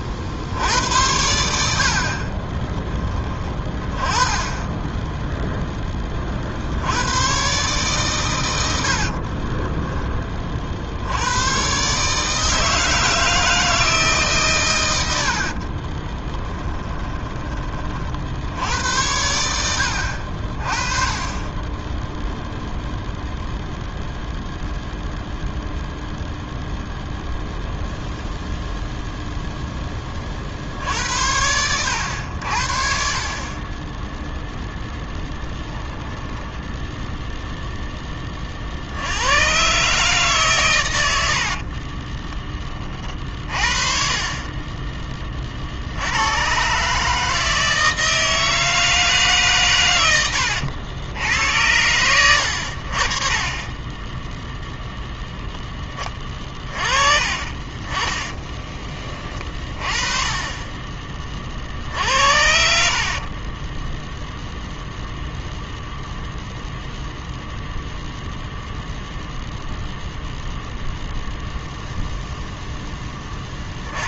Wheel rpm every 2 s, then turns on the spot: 80, 10, 10, 70, 80, 50, 160, 120, 20, 80, 40, 0, 0, 0, 0, 60, 70, 0, 0, 50, 130, 20, 20, 130, 160, 80, 70, 0, 30, 20, 20, 60, 0, 0, 0, 0, 0.
16-18